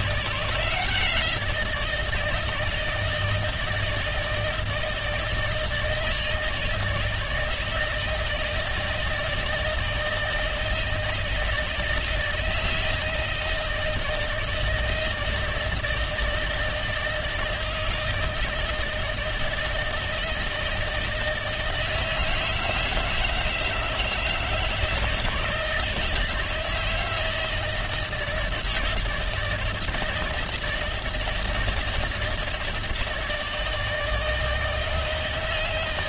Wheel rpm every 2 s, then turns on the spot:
170, 160, 160, 160, 160, 160, 160, 160, 160, 160, 160, 160, 160, 160, 160, 160, 160, 160.
none